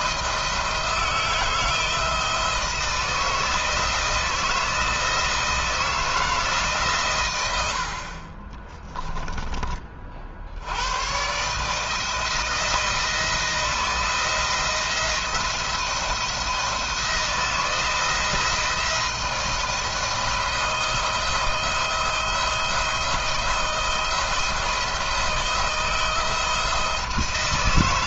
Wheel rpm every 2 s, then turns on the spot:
160, 160, 160, 150, 20, 90, 170, 170, 170, 170, 170, 170, 160, 160.
8-10